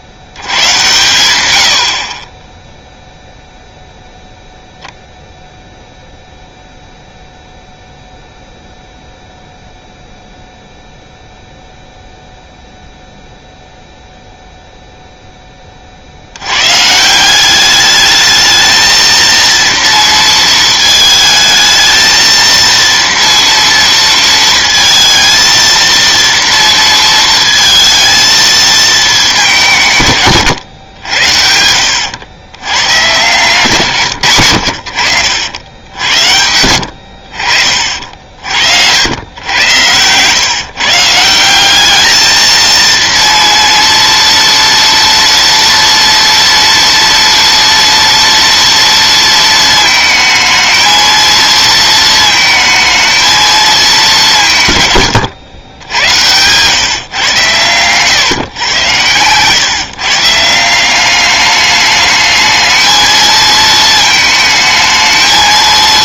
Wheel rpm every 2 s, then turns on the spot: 110, 10, 0, 0, 0, 0, 0, 0, 110, 220, 220, 230, 230, 230, 220, 130, 110, 90, 80, 60, 150, 230, 230, 230, 230, 220, 220, 140, 130, 110, 170, 220, 220.
30-32